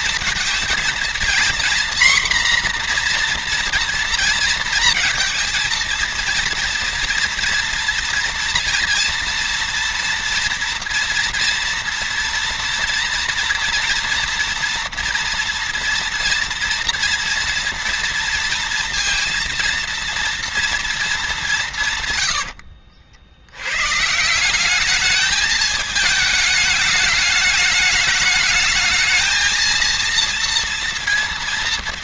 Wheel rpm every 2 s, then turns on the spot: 240, 240, 230, 230, 230, 230, 230, 230, 230, 230, 220, 80, 210, 210, 220, 230.
none